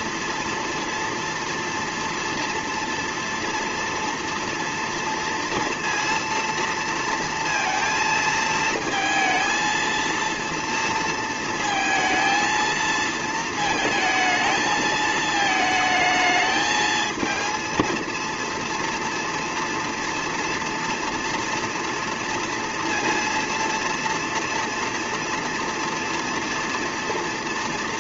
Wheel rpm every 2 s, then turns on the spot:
230, 230, 230, 230, 230, 230, 230, 220, 220, 230, 230, 230, 230, 230.
none